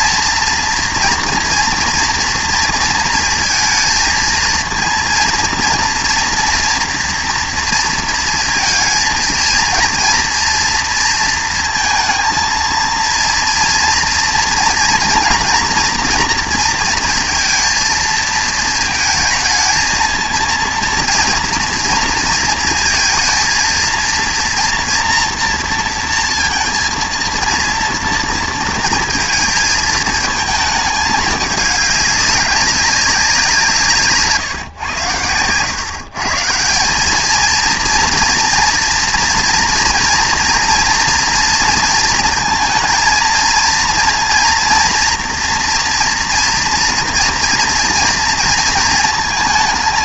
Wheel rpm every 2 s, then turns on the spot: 230, 230, 230, 230, 230, 230, 230, 230, 230, 230, 230, 230, 240, 230, 230, 220, 190, 130, 180, 230, 230, 230, 230, 230, 230.
none